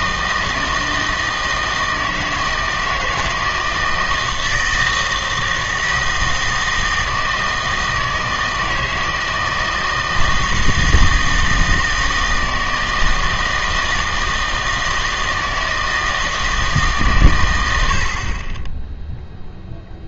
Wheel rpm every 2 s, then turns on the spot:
160, 160, 160, 160, 160, 160, 160, 160, 160, 10.
none